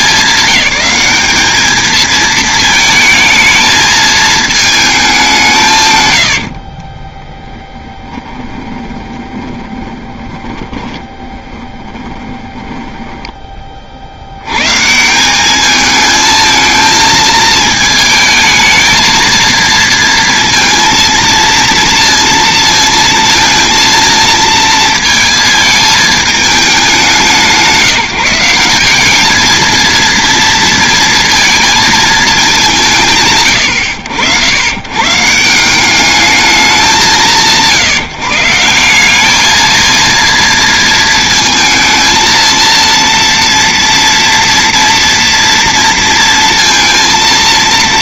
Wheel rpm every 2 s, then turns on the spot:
210, 220, 220, 50, 20, 20, 10, 110, 220, 220, 230, 230, 230, 200, 170, 230, 160, 100, 170, 160, 230, 230, 230, 230.
6-12